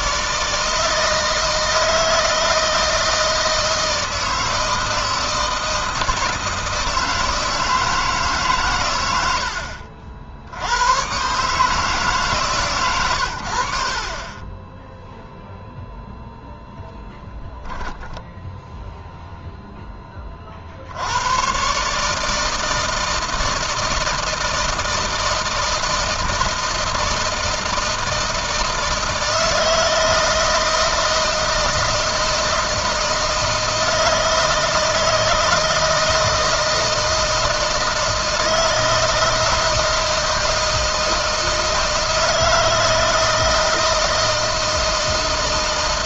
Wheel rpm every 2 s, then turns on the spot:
160, 160, 160, 160, 120, 110, 120, 0, 0, 0, 70, 160, 160, 160, 160, 160, 160, 160, 160, 160, 160, 160, 160.
none